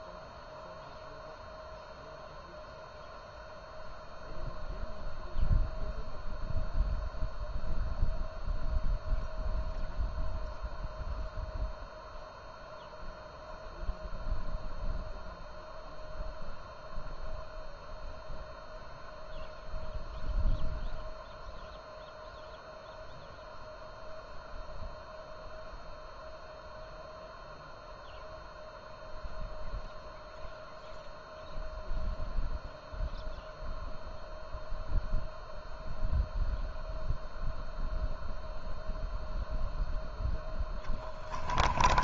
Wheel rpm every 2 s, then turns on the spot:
0, 0, 0, 0, 0, 0, 0, 0, 0, 0, 0, 0, 0, 0, 0, 0, 0, 0, 0, 0, 10.
40-42